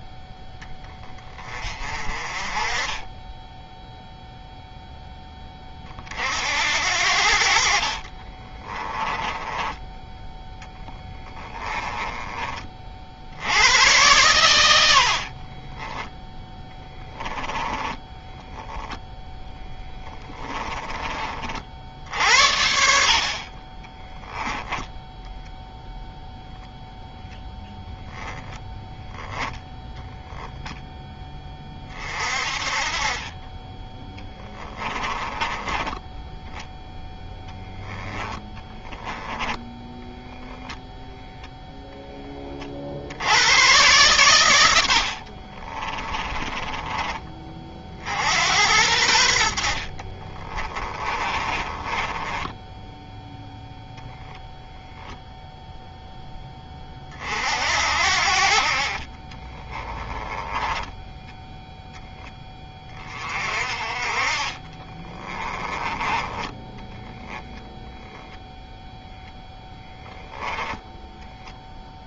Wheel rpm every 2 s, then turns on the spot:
20, 20, 10, 70, 20, 10, 50, 80, 10, 0, 20, 50, 10, 0, 10, 0, 30, 20, 0, 10, 0, 70, 90, 20, 90, 20, 10, 0, 30, 40, 10, 20, 20, 20, 0, 10.
8-12 16-18 20-22 24-26 38-40 46-48 50-52 60-62 64-68